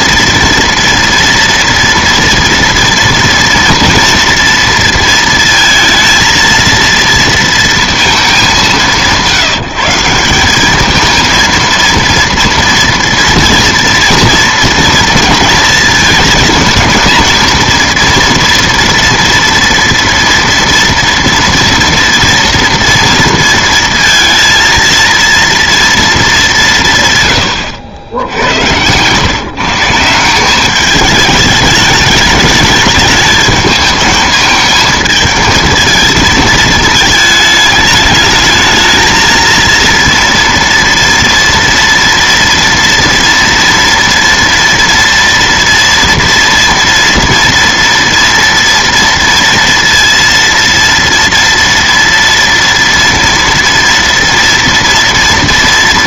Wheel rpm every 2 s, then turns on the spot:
230, 240, 230, 230, 180, 200, 230, 230, 220, 230, 230, 230, 230, 170, 100, 200, 210, 220, 220, 220, 230, 230, 230, 230, 230, 230, 230, 230.
none